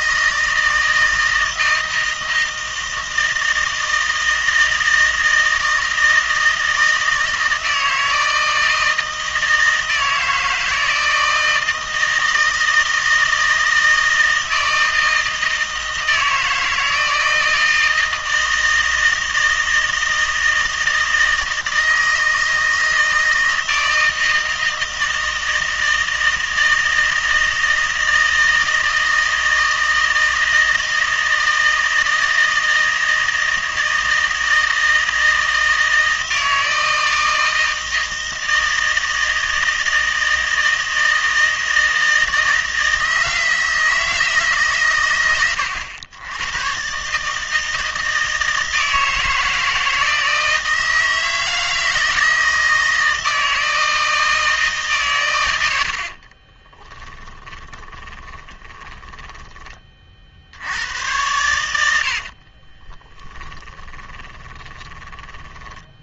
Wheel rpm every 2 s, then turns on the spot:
160, 160, 160, 160, 160, 160, 160, 160, 160, 160, 160, 160, 160, 160, 160, 160, 160, 160, 160, 160, 160, 160, 130, 110, 160, 160, 160, 150, 20, 20, 80, 30, 20.
56-60 62-66